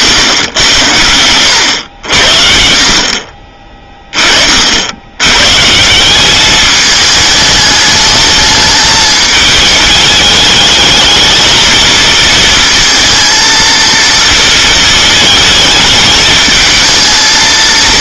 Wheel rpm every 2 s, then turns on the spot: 110, 60, 60, 210, 210, 220, 230, 220, 220.
none